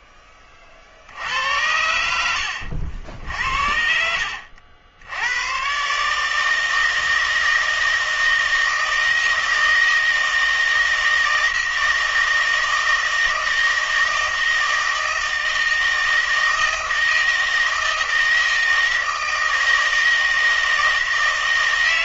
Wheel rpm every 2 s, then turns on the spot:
40, 60, 50, 160, 160, 160, 160, 160, 160, 160, 160.
none